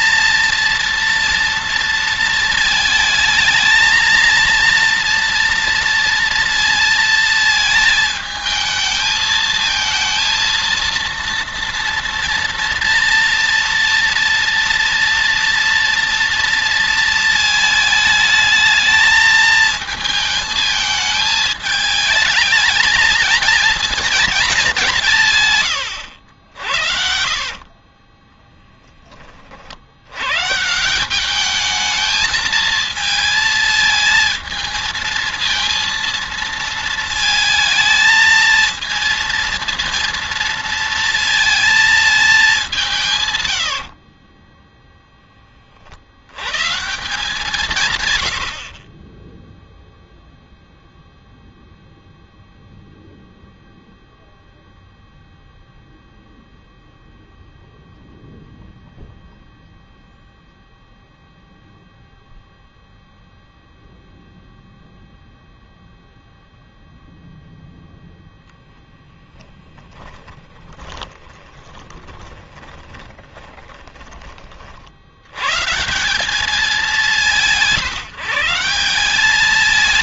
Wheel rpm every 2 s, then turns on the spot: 230, 220, 230, 230, 220, 230, 230, 230, 230, 220, 220, 220, 170, 60, 10, 170, 220, 220, 230, 230, 230, 170, 0, 150, 30, 0, 0, 0, 0, 0, 0, 0, 0, 0, 10, 20, 20, 50, 180, 180.
68-74